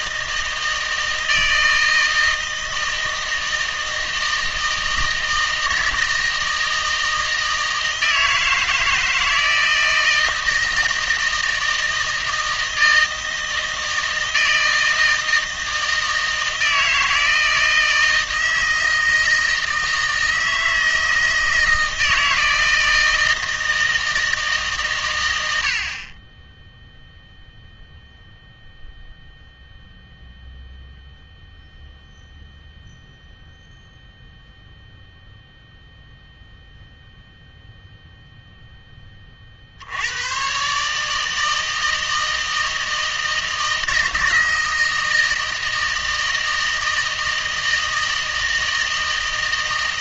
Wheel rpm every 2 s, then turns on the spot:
160, 160, 160, 160, 160, 160, 160, 160, 160, 160, 160, 160, 140, 0, 0, 0, 0, 0, 0, 10, 140, 160, 160, 160, 160.
none